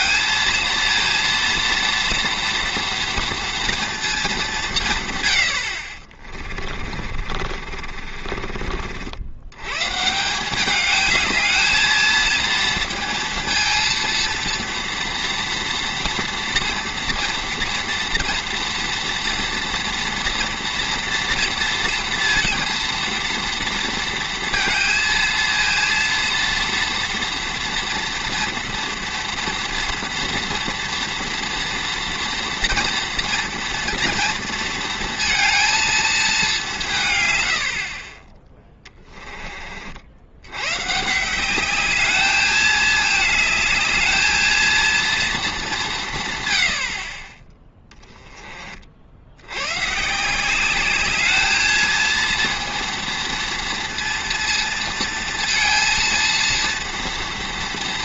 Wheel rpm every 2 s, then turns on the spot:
230, 230, 180, 30, 50, 190, 230, 230, 230, 230, 230, 230, 230, 230, 230, 230, 230, 230, 200, 20, 110, 210, 230, 110, 40, 190, 230, 230, 230.
6-8